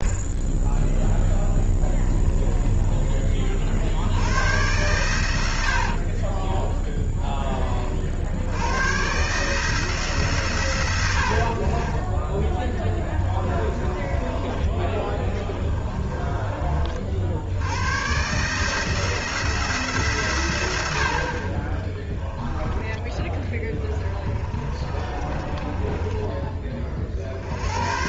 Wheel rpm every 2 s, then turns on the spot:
10, 20, 100, 10, 100, 120, 10, 20, 40, 150, 70, 10, 30, 30.
0-4 6-8 12-16 24-26